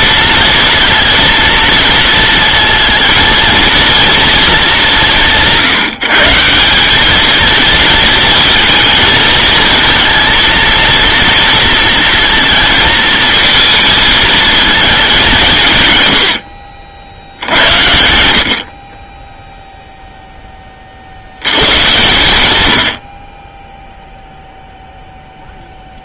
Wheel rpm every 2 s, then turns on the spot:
230, 230, 200, 180, 230, 230, 230, 210, 60, 50, 30, 90, 0.
none